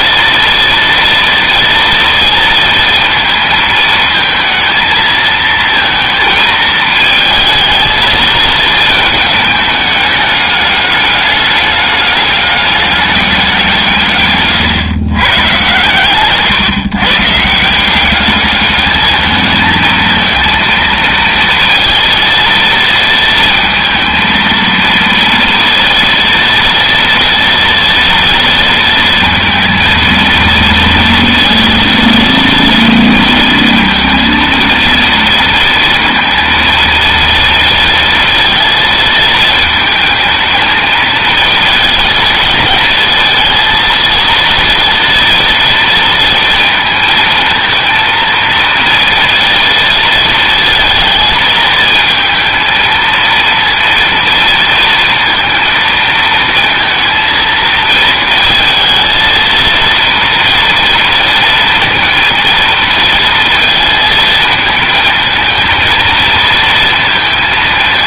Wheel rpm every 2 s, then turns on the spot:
230, 230, 220, 220, 220, 210, 210, 140, 130, 210, 230, 230, 230, 230, 230, 230, 230, 230, 230, 230, 220, 220, 230, 230, 230, 230, 230, 230, 230, 220, 230, 230, 220, 230.
none